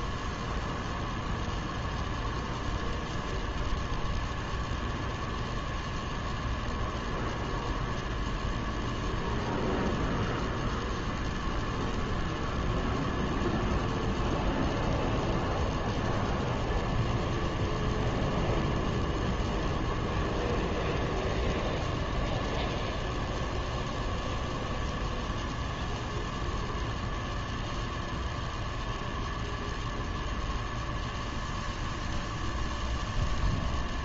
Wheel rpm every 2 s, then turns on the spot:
0, 0, 0, 0, 0, 0, 0, 0, 0, 0, 0, 0, 0, 0, 0, 0, 0.
none